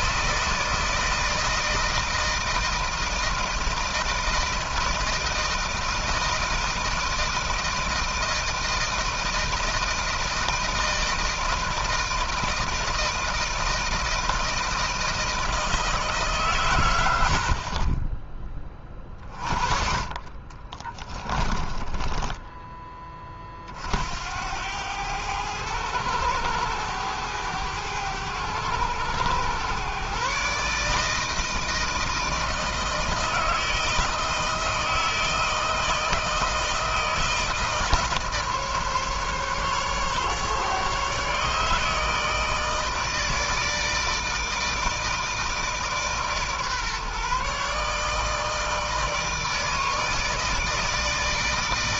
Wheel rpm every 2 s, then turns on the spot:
160, 160, 160, 160, 160, 160, 160, 160, 120, 20, 30, 20, 90, 100, 100, 150, 160, 160, 160, 150, 150, 160, 160, 140, 160, 160.
16-18 20-22